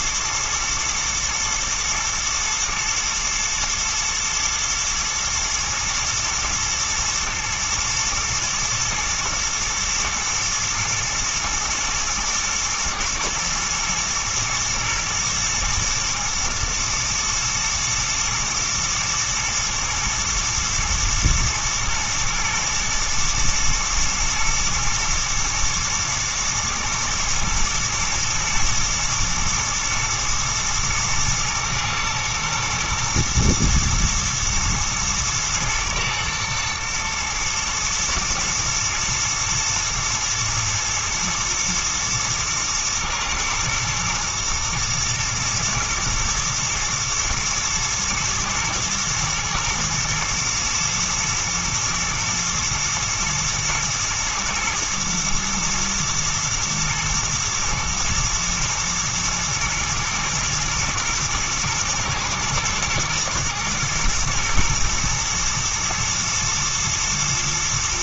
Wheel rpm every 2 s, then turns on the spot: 120, 110, 110, 120, 110, 120, 110, 120, 120, 110, 110, 110, 120, 110, 120, 110, 110, 110, 110, 120, 110, 110, 110, 110, 120, 120, 120, 120, 110, 110, 110, 110, 110, 110.
none